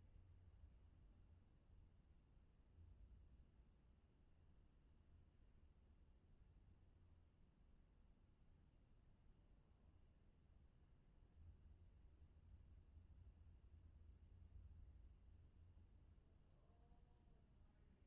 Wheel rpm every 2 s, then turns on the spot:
0, 0, 0, 0, 0, 0, 0, 0, 0.
none